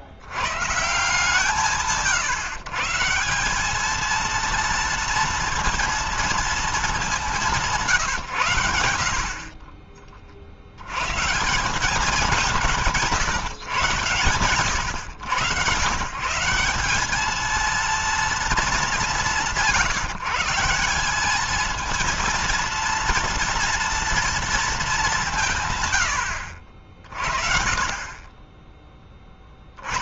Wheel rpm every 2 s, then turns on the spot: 130, 150, 230, 220, 110, 60, 190, 120, 180, 220, 170, 230, 220, 60, 20.
none